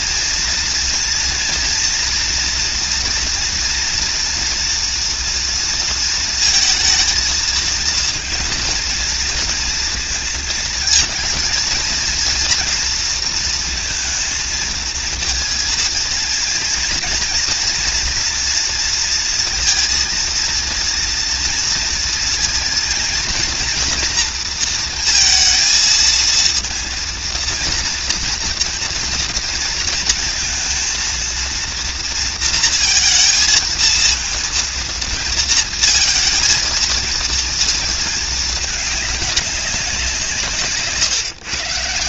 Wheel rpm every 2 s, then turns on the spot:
230, 230, 230, 230, 230, 230, 230, 230, 230, 230, 230, 230, 230, 230, 230, 230, 230, 230, 220, 220, 150.
none